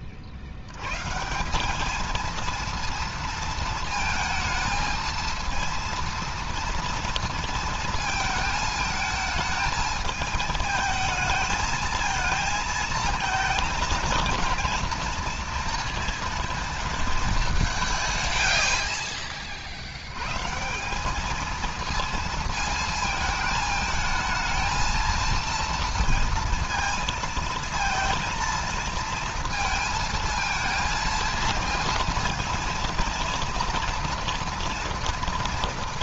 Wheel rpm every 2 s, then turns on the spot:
130, 230, 230, 230, 220, 220, 220, 230, 220, 70, 200, 220, 230, 230, 230, 220, 230, 230.
none